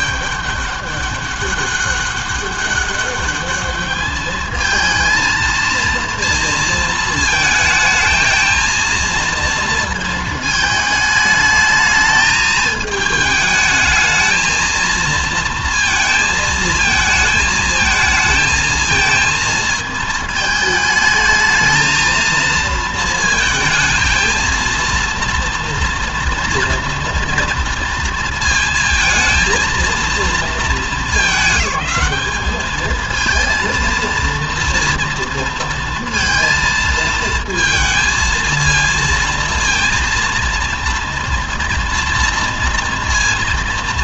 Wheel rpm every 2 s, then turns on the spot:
200, 200, 220, 230, 220, 220, 220, 220, 220, 220, 220, 230, 230, 230, 230, 200, 210, 230, 230, 230, 230, 230.
none